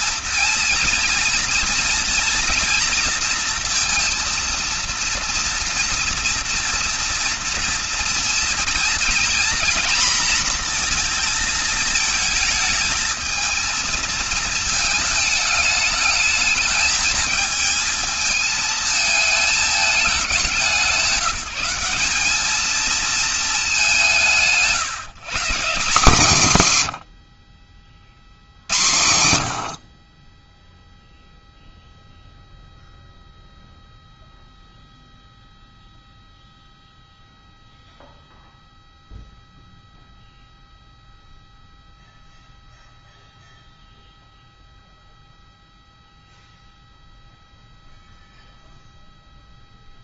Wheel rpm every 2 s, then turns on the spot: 240, 230, 230, 230, 240, 230, 220, 220, 220, 220, 190, 230, 160, 110, 90, 0, 0, 0, 0, 0, 0, 0, 0, 0, 0.
none